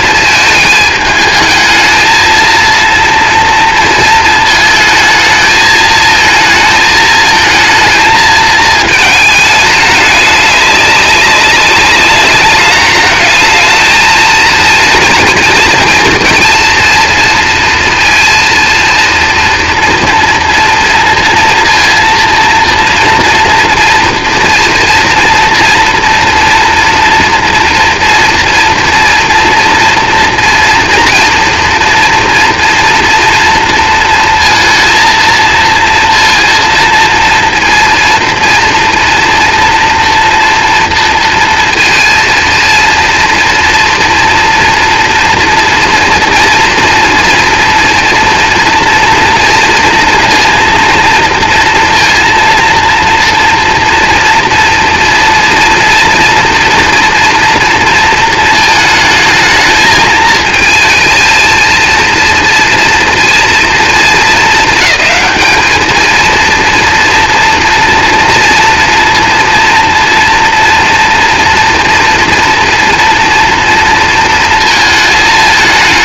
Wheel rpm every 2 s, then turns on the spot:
220, 230, 220, 220, 220, 210, 210, 230, 230, 230, 230, 240, 240, 230, 230, 230, 230, 230, 230, 230, 230, 230, 230, 230, 230, 230, 230, 230, 240, 220, 220, 230, 220, 230, 230, 230, 230, 220.
none